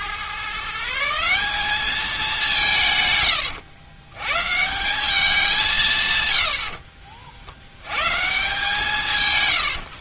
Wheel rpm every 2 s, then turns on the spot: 160, 150, 170, 60, 150.
none